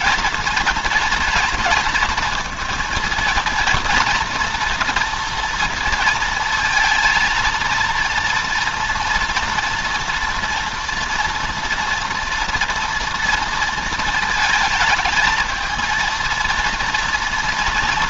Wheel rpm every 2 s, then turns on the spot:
230, 220, 230, 230, 230, 230, 230, 220, 230.
none